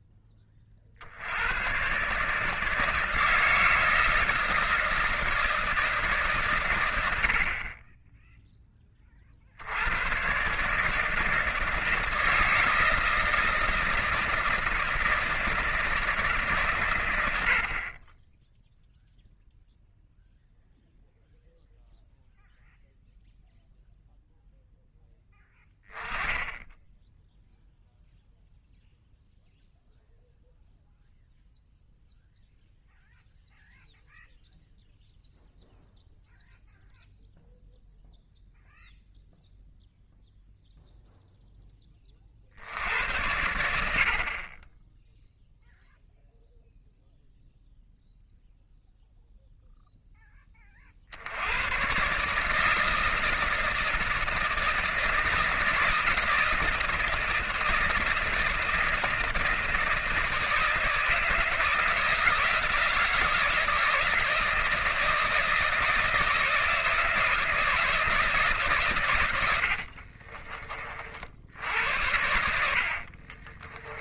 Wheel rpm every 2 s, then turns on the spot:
50, 160, 160, 120, 10, 140, 160, 160, 130, 10, 0, 0, 0, 10, 0, 0, 0, 0, 0, 0, 0, 70, 20, 0, 0, 30, 150, 160, 160, 160, 160, 160, 160, 160, 130, 40, 70.
none